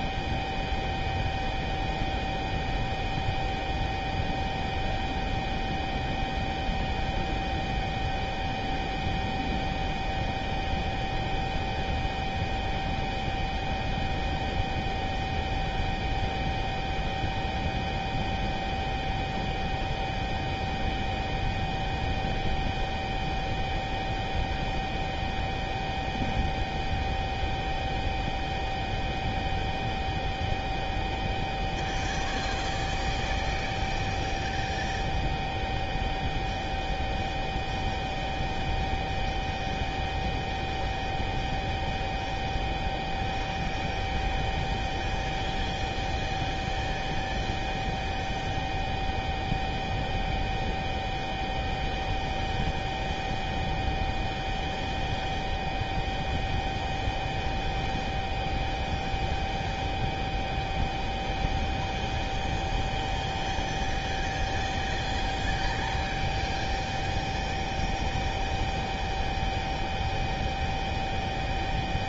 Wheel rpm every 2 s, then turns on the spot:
0, 0, 0, 0, 0, 0, 0, 0, 0, 0, 0, 0, 0, 0, 0, 0, 0, 0, 0, 0, 0, 0, 0, 0, 0, 0, 0, 0, 0, 0, 0, 0, 0, 0, 0, 0.
none